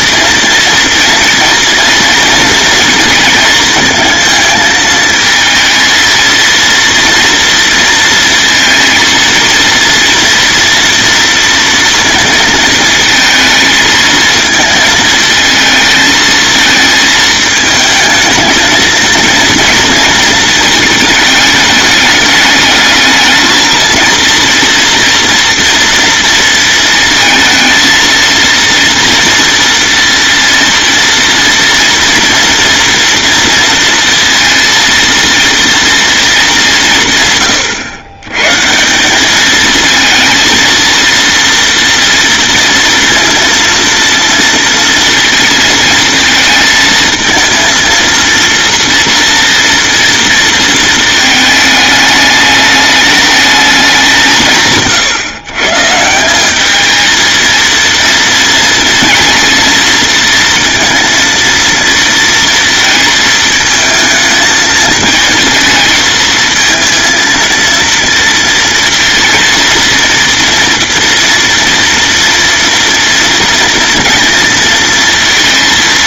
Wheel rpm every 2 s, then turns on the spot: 230, 230, 220, 230, 220, 240, 220, 220, 220, 230, 220, 220, 230, 230, 230, 230, 230, 230, 170, 170, 230, 230, 230, 220, 230, 220, 210, 130, 220, 220, 230, 230, 220, 230, 230, 230, 230, 230.
none